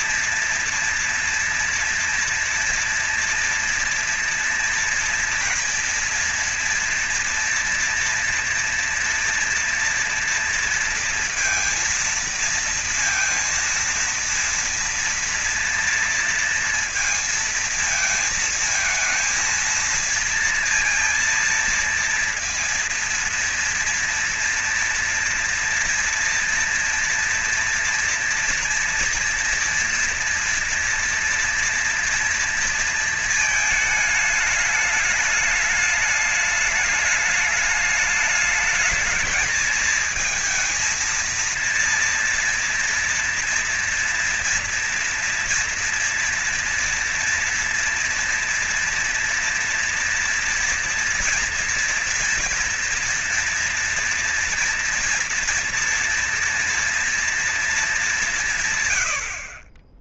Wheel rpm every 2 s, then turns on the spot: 230, 230, 230, 230, 230, 230, 230, 230, 230, 220, 230, 230, 230, 230, 230, 230, 230, 210, 210, 220, 230, 230, 230, 230, 230, 230, 230, 240, 230, 110.
none